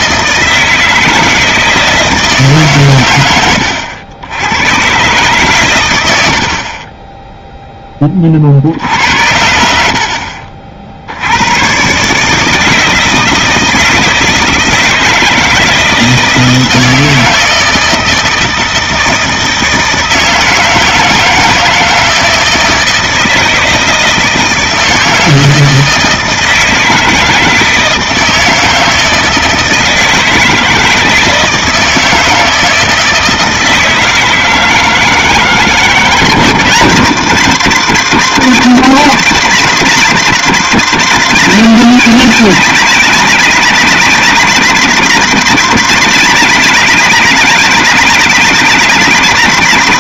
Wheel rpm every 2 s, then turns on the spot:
160, 130, 130, 20, 80, 60, 160, 160, 160, 160, 160, 160, 160, 160, 160, 160, 160, 160, 170, 170, 180, 180, 170, 180, 170.
6-8